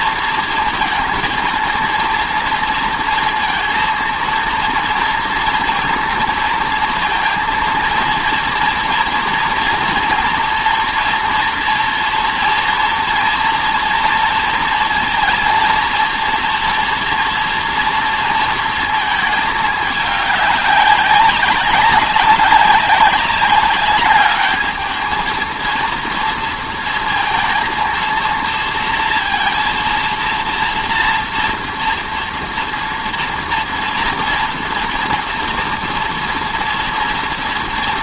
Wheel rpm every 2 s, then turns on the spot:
230, 230, 230, 230, 230, 230, 240, 230, 230, 230, 200, 200, 210, 230, 230, 230, 230, 240, 230.
none